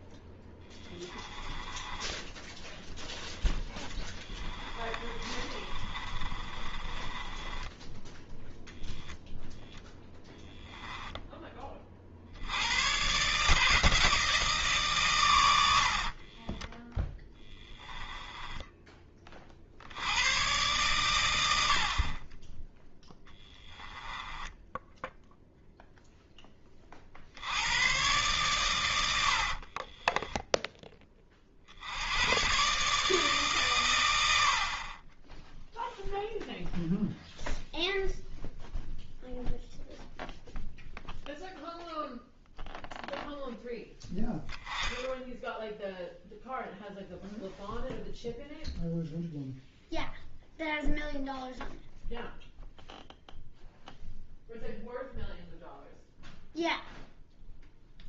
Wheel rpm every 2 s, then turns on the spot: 10, 10, 30, 20, 0, 0, 110, 140, 10, 10, 110, 10, 10, 30, 110, 20, 140, 40, 0, 0, 0, 0, 30, 0, 0, 0, 0, 0, 0.
0-2 4-8 16-18 24-26 30-32